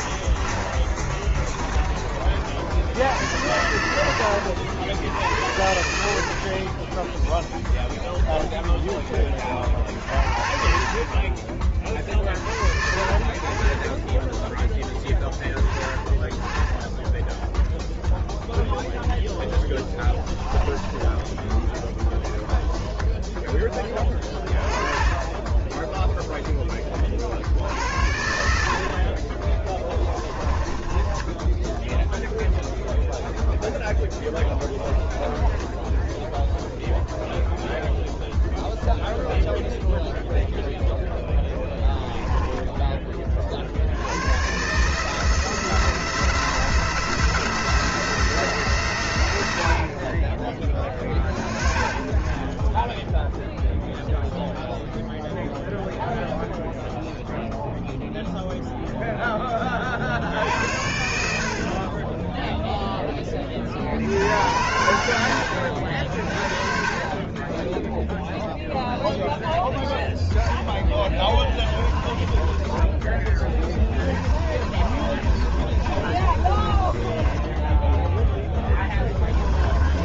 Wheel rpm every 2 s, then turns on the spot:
30, 70, 80, 20, 10, 40, 50, 10, 10, 0, 10, 0, 20, 20, 50, 20, 0, 20, 0, 0, 0, 10, 140, 160, 130, 20, 10, 0, 0, 0, 70, 10, 90, 40, 10, 10, 20, 30, 20, 20.
0-2 6-8 30-32 34-36 70-72 74-80